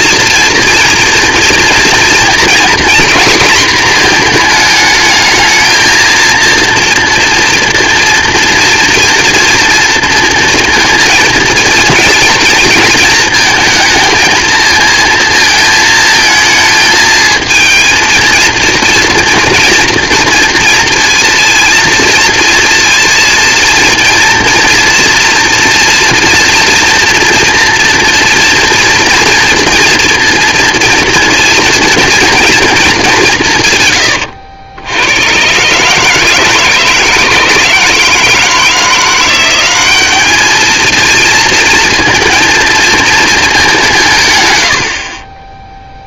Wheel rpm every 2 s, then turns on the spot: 240, 230, 220, 230, 230, 230, 230, 230, 220, 230, 230, 230, 240, 230, 230, 240, 230, 90, 150, 160, 210, 230, 120.
none